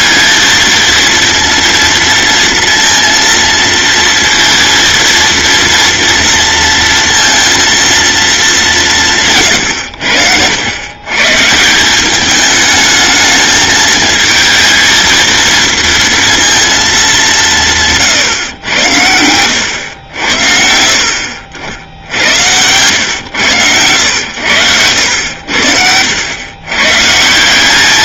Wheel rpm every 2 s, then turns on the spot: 230, 230, 230, 230, 180, 110, 210, 230, 220, 90, 70, 110, 90, 130.
24-26